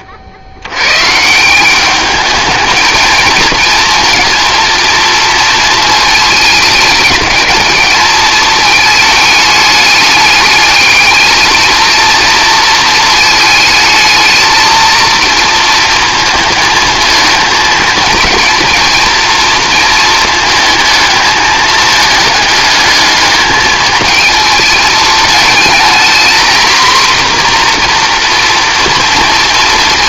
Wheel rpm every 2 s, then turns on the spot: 100, 220, 230, 220, 220, 210, 230, 220, 220, 230, 220, 210, 220, 240, 230.
none